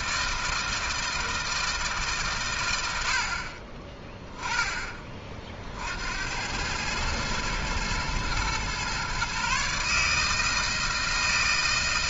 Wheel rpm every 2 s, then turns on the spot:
160, 110, 20, 100, 120, 160.
none